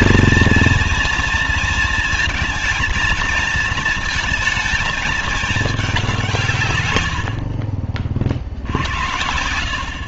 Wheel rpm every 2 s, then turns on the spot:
230, 230, 220, 160, 60.
none